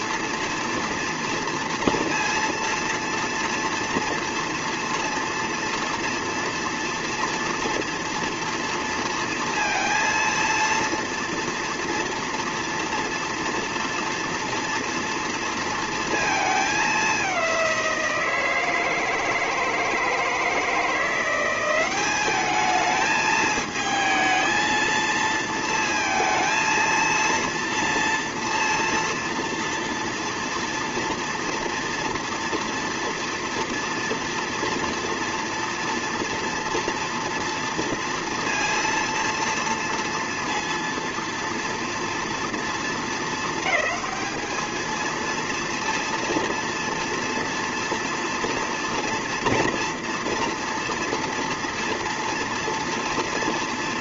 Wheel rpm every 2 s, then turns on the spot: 230, 230, 230, 230, 230, 230, 230, 230, 210, 160, 160, 210, 220, 230, 230, 230, 230, 230, 230, 230, 230, 230, 220, 230, 230, 230, 230.
none